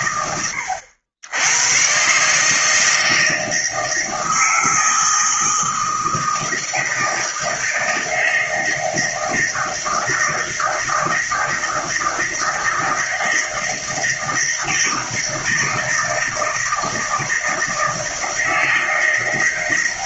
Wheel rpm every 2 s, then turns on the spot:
100, 160, 160, 160, 160, 160, 160, 160, 160, 160.
none